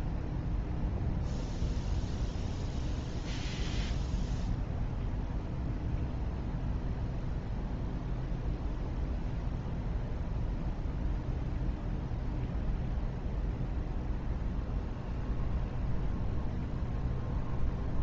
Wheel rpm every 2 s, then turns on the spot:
0, 0, 0, 0, 0, 0, 0, 0, 0.
none